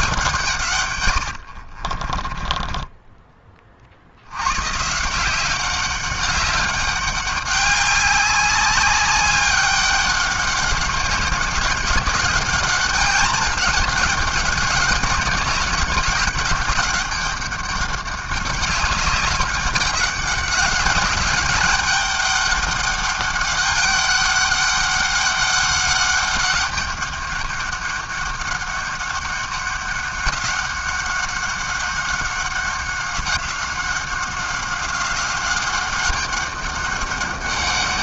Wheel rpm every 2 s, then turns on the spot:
130, 20, 130, 200, 190, 200, 200, 200, 200, 200, 200, 200, 200, 200, 200, 190, 190, 190, 200.
2-4